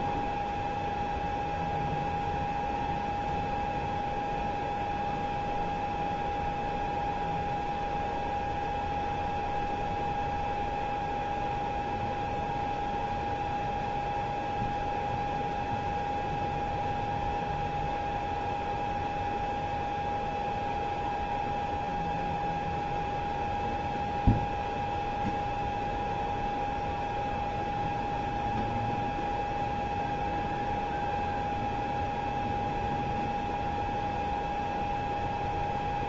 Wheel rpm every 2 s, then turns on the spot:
0, 0, 0, 0, 0, 0, 0, 0, 0, 0, 0, 0, 0, 0, 0, 0, 0, 0.
none